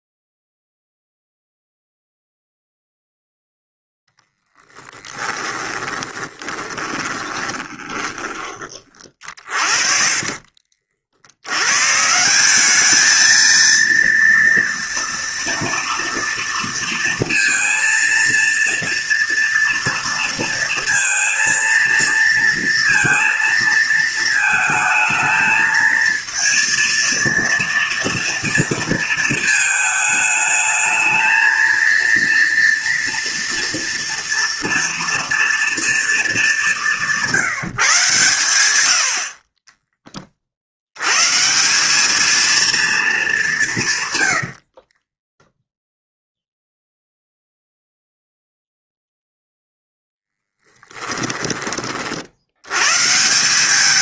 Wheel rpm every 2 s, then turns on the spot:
0, 0, 10, 20, 30, 60, 200, 230, 230, 230, 230, 230, 220, 230, 230, 220, 230, 230, 200, 90, 80, 230, 60, 0, 0, 10, 110.
4-10 44-46 50-52